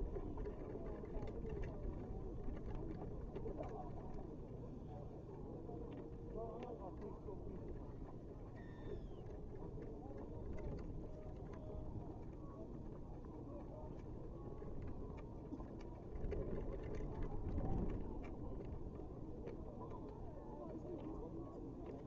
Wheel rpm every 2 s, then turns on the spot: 0, 0, 0, 0, 0, 0, 0, 0, 0, 0, 0.
none